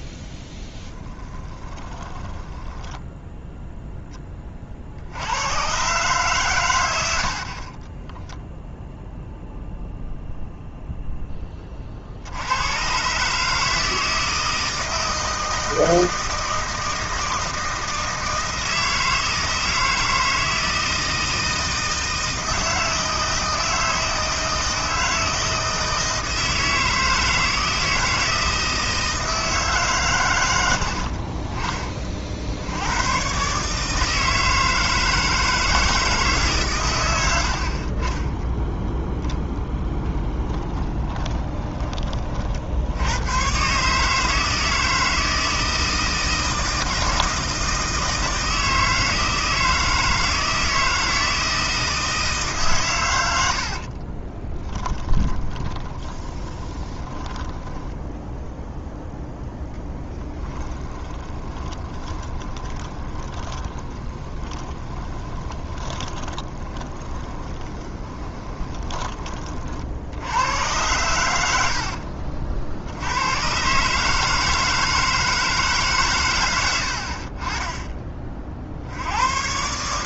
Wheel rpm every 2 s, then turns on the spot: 10, 10, 50, 100, 0, 0, 110, 160, 160, 160, 160, 160, 160, 160, 160, 80, 90, 160, 130, 10, 10, 60, 160, 160, 160, 160, 130, 10, 20, 0, 10, 10, 20, 20, 20, 100, 50, 160, 90, 60.
0-4 40-42 54-58 60-70